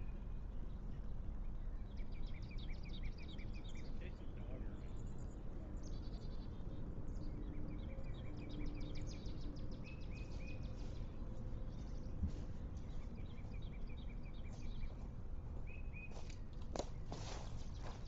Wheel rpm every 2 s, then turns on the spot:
0, 0, 0, 0, 0, 0, 0, 0, 0.
none